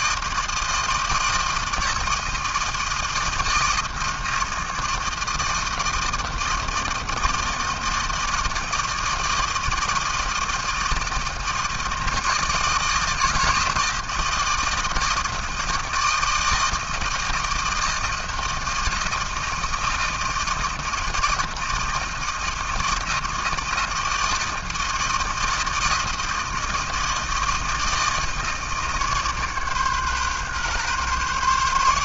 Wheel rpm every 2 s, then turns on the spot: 160, 160, 160, 160, 160, 160, 160, 160, 160, 160, 160, 160, 160, 160, 150, 140.
none